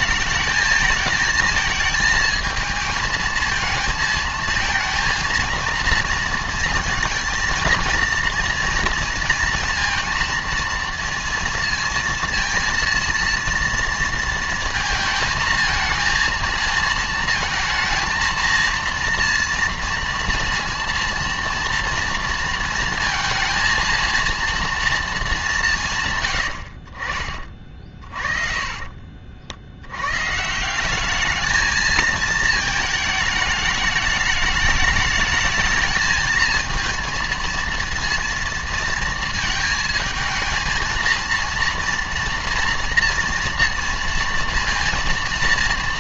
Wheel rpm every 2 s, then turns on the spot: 220, 230, 230, 230, 230, 230, 230, 230, 230, 230, 230, 230, 230, 80, 30, 160, 220, 210, 230, 230, 230, 230, 230.
28-30